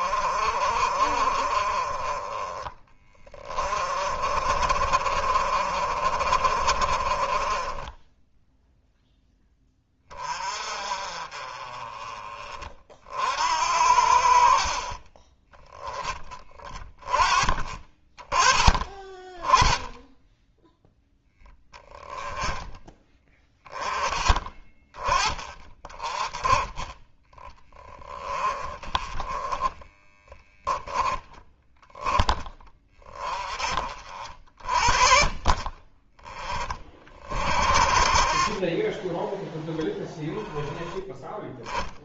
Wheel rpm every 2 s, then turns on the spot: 40, 20, 50, 40, 0, 30, 30, 40, 20, 30, 10, 20, 20, 20, 20, 10, 20, 50, 30, 40, 10.
2-8